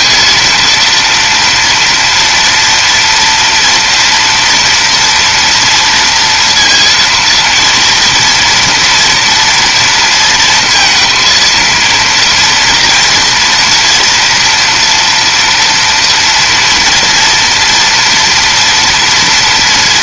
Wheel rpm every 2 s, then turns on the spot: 230, 230, 230, 230, 230, 230, 230, 230, 230, 240.
none